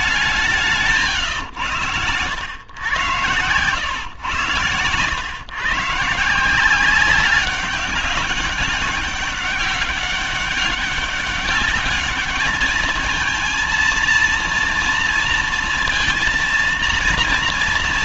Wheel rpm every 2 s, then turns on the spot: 160, 90, 100, 170, 200, 200, 220, 230, 230.
none